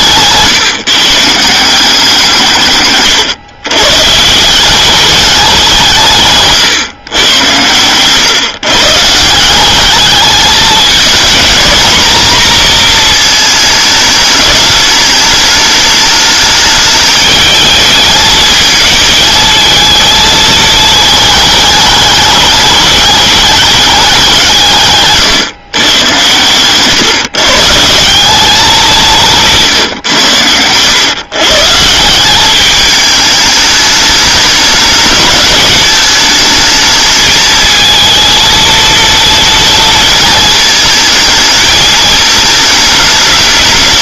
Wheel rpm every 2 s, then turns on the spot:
150, 150, 180, 140, 140, 210, 230, 210, 210, 220, 220, 200, 150, 120, 190, 100, 210, 200, 220, 230, 220, 210.
none